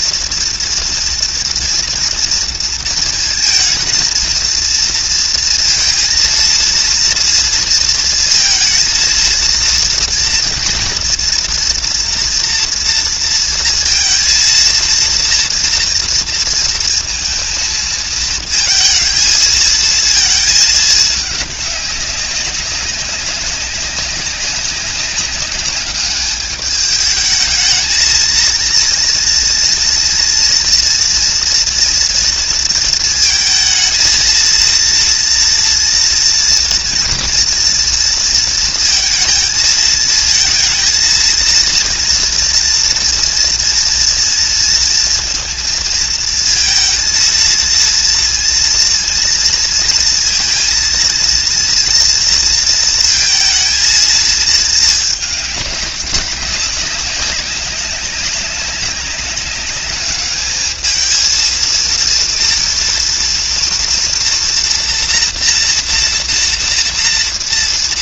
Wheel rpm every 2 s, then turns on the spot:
230, 230, 230, 230, 230, 230, 230, 230, 230, 230, 220, 200, 190, 210, 230, 240, 230, 230, 230, 230, 230, 230, 230, 230, 240, 230, 230, 220, 190, 200, 210, 230, 240, 230.
none